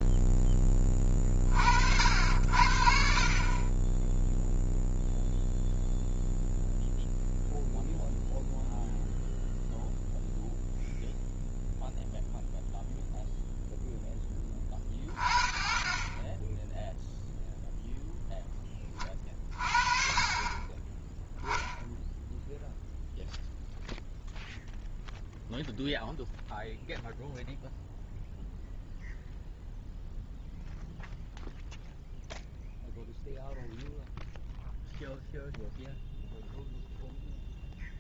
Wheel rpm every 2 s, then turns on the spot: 20, 60, 0, 0, 0, 0, 0, 30, 10, 20, 30, 0, 0, 0, 0, 0, 0, 0, 0.
none